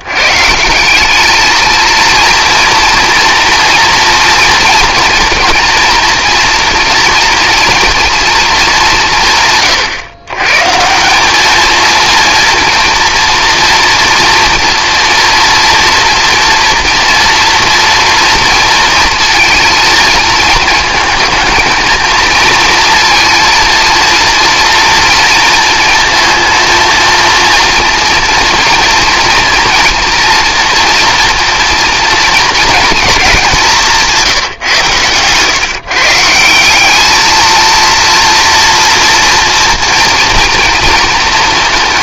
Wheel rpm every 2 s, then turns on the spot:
140, 240, 230, 230, 210, 130, 230, 230, 230, 230, 230, 230, 240, 230, 230, 230, 230, 160, 170, 230, 230.
none